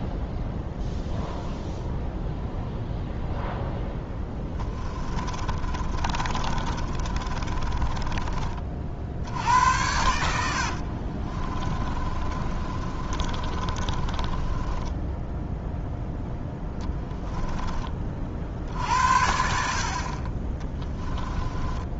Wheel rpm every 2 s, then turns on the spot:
0, 0, 20, 30, 40, 70, 30, 10, 10, 60, 10.
4-8 10-16 20-22